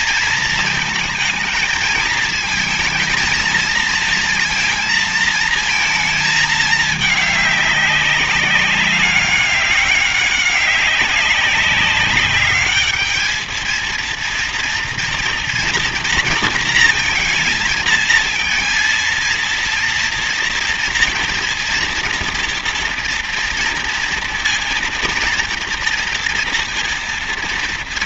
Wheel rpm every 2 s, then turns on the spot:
220, 230, 230, 220, 190, 190, 210, 230, 230, 220, 230, 230, 240, 230.
none